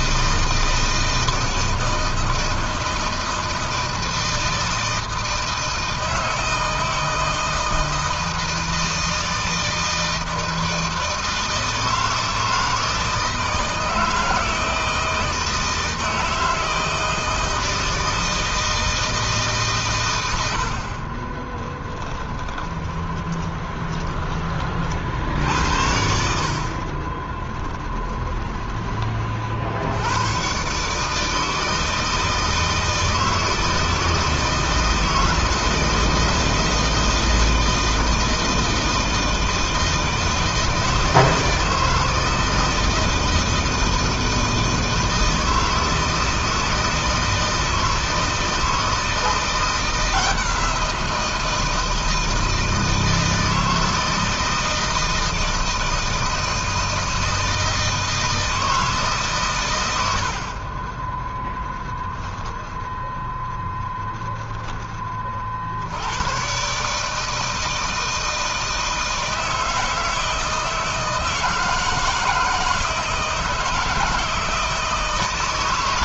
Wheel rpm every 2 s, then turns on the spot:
160, 160, 160, 170, 160, 160, 160, 160, 160, 160, 50, 20, 50, 40, 30, 140, 160, 160, 160, 160, 160, 160, 160, 160, 160, 170, 160, 160, 160, 150, 20, 0, 20, 140, 160, 160, 160, 160.
20-24 26-28